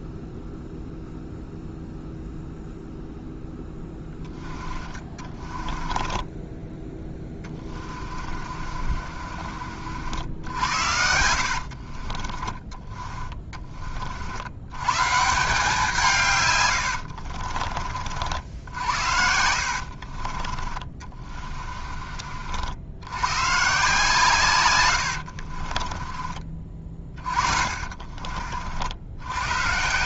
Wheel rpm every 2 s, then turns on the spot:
0, 0, 20, 10, 40, 80, 20, 140, 90, 70, 30, 80, 100, 30, 70.
4-6 8-14 16-18 20-22 24-28